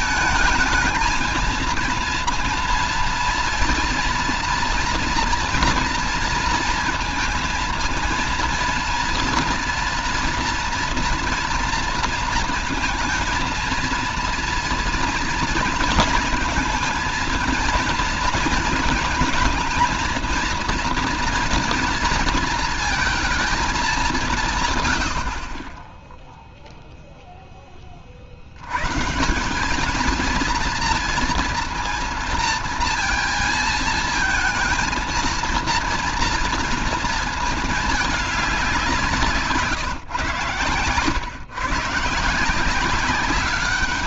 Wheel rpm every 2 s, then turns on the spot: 220, 230, 230, 230, 230, 230, 230, 230, 230, 230, 230, 230, 160, 0, 60, 230, 230, 220, 230, 200, 130, 160.
none